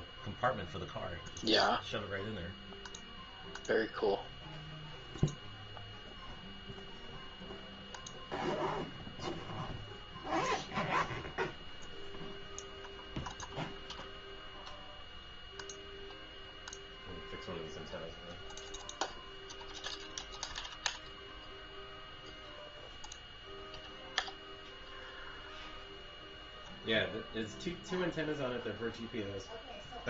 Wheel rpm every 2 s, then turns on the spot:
0, 0, 0, 0, 0, 0, 0, 0, 0, 0, 0, 0, 0, 0, 0.
none